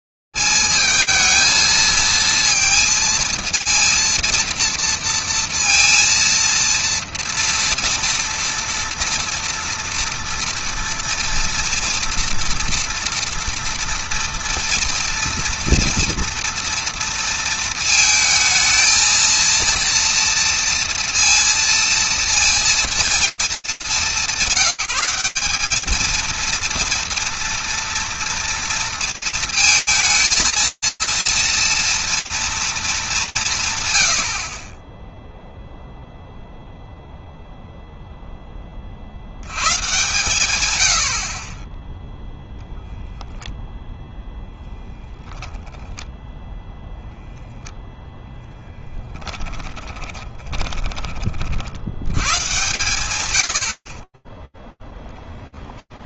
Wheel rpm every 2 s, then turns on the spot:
90, 220, 230, 230, 230, 230, 230, 230, 230, 230, 230, 230, 220, 220, 230, 220, 230, 110, 0, 20, 120, 0, 0, 0, 10, 40, 90, 0.
48-50